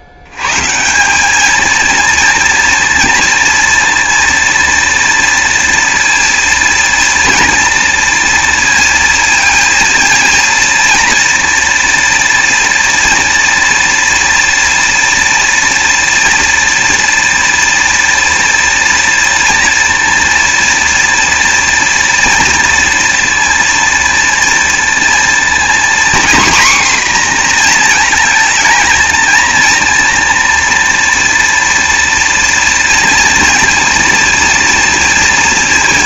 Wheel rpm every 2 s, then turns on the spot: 140, 230, 230, 230, 230, 230, 240, 230, 230, 230, 230, 230, 230, 250, 220, 240, 230, 230.
none